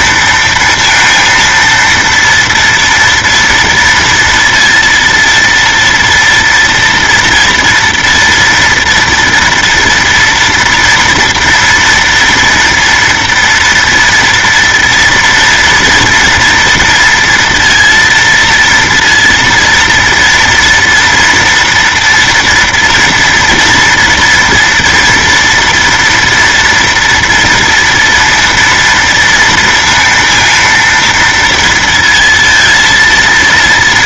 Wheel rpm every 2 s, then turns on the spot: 230, 230, 230, 230, 230, 230, 230, 230, 230, 230, 230, 230, 230, 240, 230, 230, 230.
none